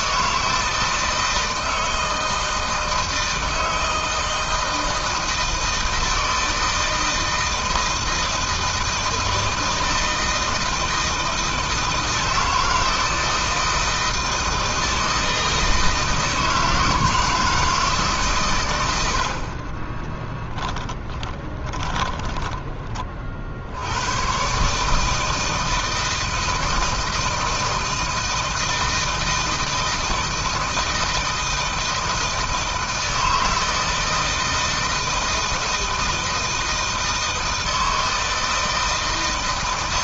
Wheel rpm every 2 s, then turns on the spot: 160, 160, 160, 160, 160, 160, 160, 160, 160, 60, 20, 50, 150, 160, 160, 160, 160, 160, 160, 160.
20-22